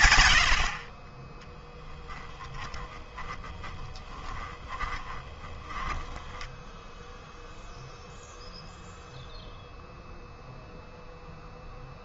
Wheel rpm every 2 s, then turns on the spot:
70, 10, 20, 10, 0, 0.
2-8